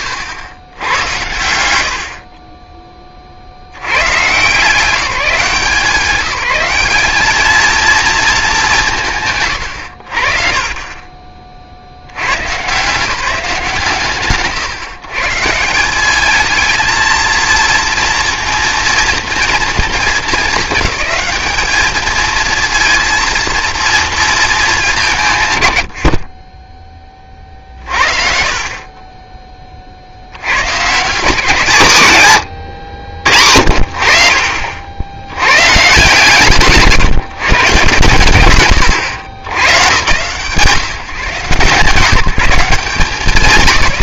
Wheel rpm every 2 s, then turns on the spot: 100, 20, 160, 190, 190, 30, 150, 120, 220, 230, 210, 230, 200, 10, 40, 90, 130, 50, 140, 120, 150, 160.
32-34